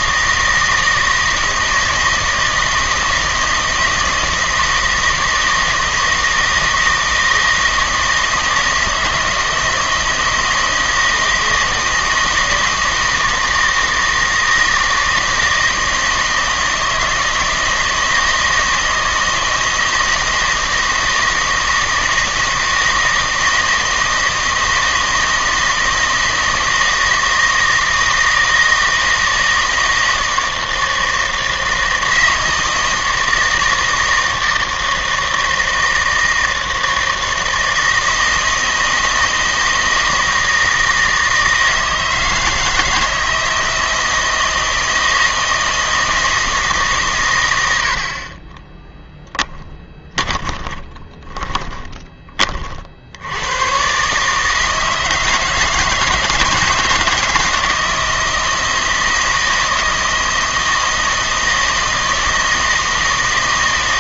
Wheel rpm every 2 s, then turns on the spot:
160, 160, 160, 160, 160, 160, 160, 160, 160, 160, 160, 160, 160, 160, 160, 160, 160, 160, 160, 160, 160, 160, 160, 150, 20, 20, 40, 160, 160, 160, 160, 160.
48-52